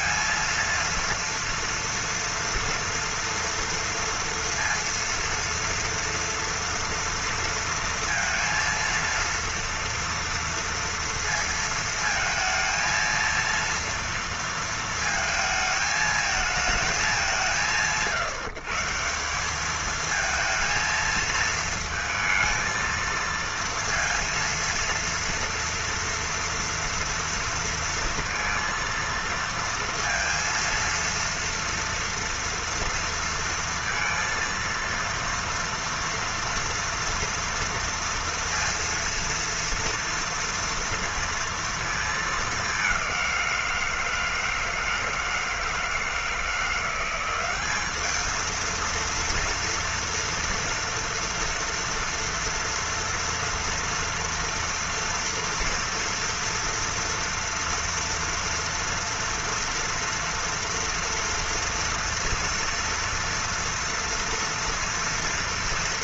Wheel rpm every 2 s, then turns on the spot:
230, 230, 230, 230, 230, 230, 230, 230, 220, 160, 230, 230, 230, 240, 230, 230, 230, 230, 240, 230, 230, 200, 160, 170, 230, 230, 230, 230, 230, 230, 230, 230, 230.
none